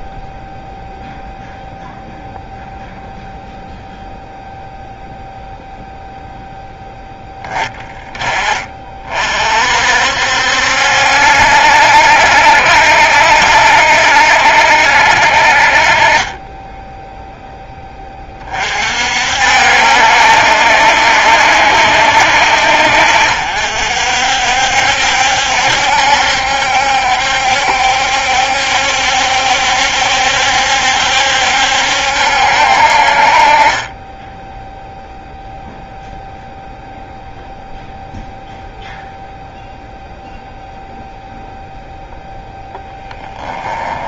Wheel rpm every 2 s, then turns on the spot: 0, 0, 0, 0, 30, 60, 70, 60, 10, 50, 70, 60, 70, 70, 70, 70, 60, 0, 0, 0, 0, 10.
16-18